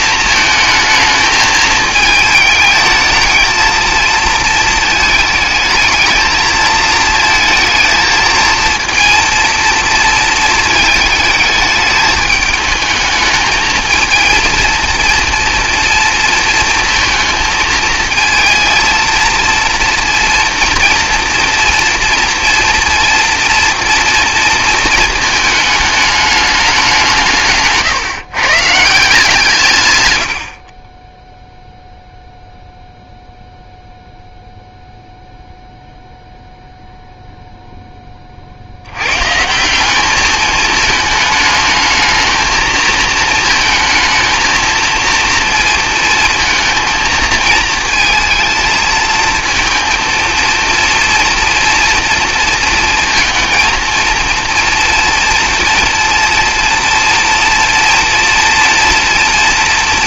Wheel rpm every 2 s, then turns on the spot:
220, 220, 220, 220, 230, 220, 220, 230, 230, 230, 230, 230, 220, 190, 160, 30, 0, 0, 0, 90, 220, 230, 230, 230, 220, 230, 230, 230, 230, 240.
none